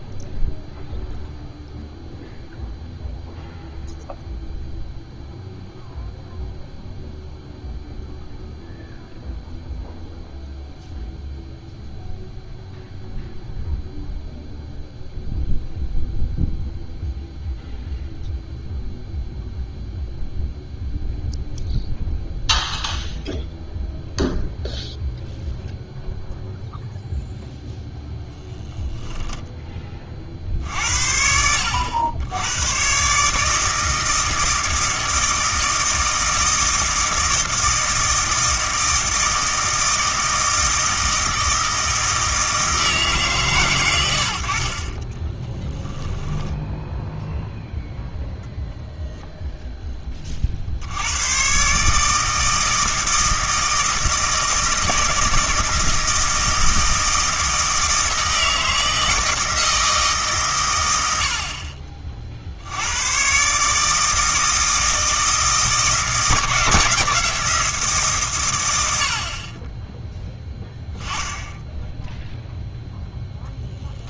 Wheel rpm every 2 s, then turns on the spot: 0, 0, 0, 0, 0, 0, 0, 0, 0, 0, 0, 0, 0, 0, 10, 60, 110, 160, 160, 160, 160, 160, 40, 0, 10, 80, 160, 160, 160, 160, 120, 80, 160, 160, 90, 10, 0.
28-30